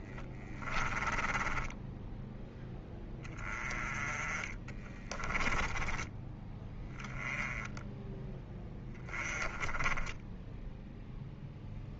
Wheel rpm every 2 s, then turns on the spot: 10, 10, 20, 20, 10, 10.
0-6